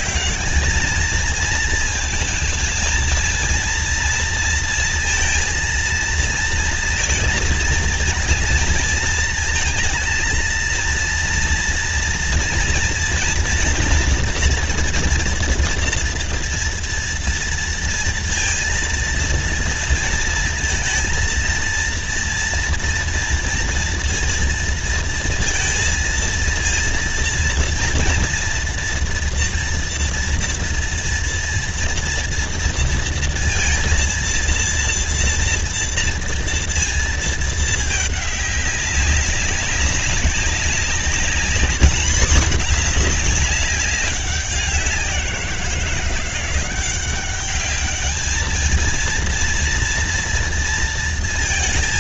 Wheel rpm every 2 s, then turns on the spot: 210, 230, 230, 230, 230, 230, 230, 230, 230, 230, 230, 230, 230, 230, 230, 230, 230, 230, 230, 200, 200, 210, 190, 180, 220, 230.
none